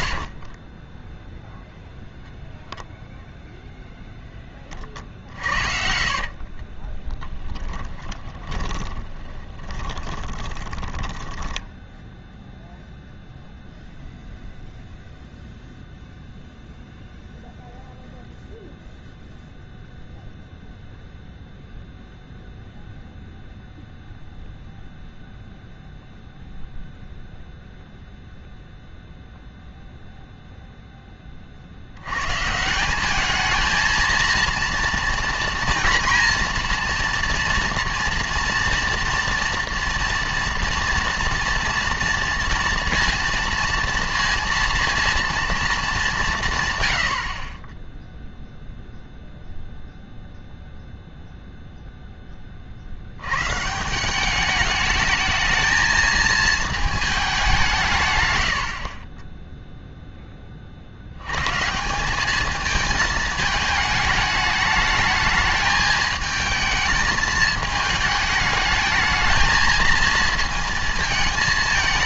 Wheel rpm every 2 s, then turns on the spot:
40, 0, 30, 40, 20, 20, 0, 0, 0, 0, 0, 0, 0, 0, 0, 0, 160, 230, 230, 230, 230, 230, 230, 130, 0, 0, 50, 210, 220, 70, 50, 220, 210, 220, 210, 220.
0-2 4-12